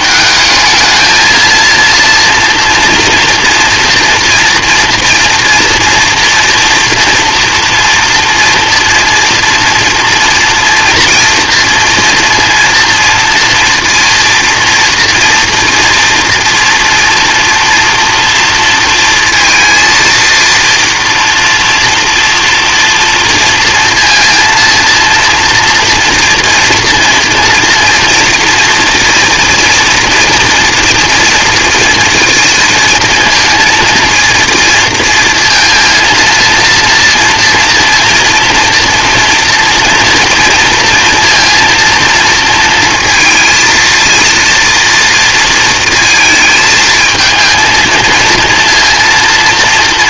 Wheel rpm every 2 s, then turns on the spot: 210, 230, 230, 230, 230, 240, 230, 230, 240, 230, 230, 230, 230, 240, 230, 230, 230, 230, 230, 230, 230, 230, 230, 220, 230.
none